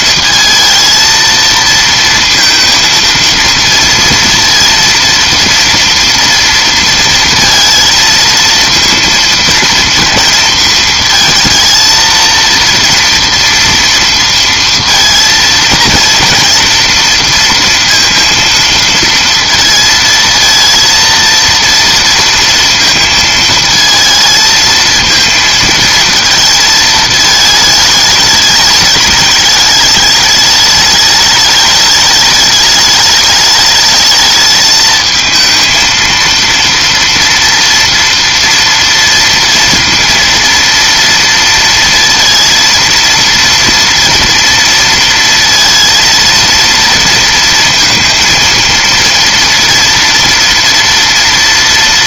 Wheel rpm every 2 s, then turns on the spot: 220, 230, 230, 230, 230, 230, 230, 230, 230, 230, 230, 230, 220, 220, 210, 210, 210, 220, 230, 230, 230, 230, 230, 230, 230, 230.
none